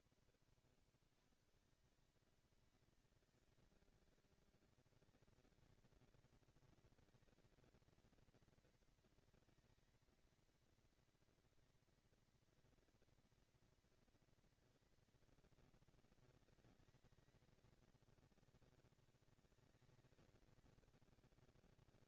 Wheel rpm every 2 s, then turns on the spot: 160, 210, 220, 220, 230, 230, 240, 230, 230, 220, 220.
0-2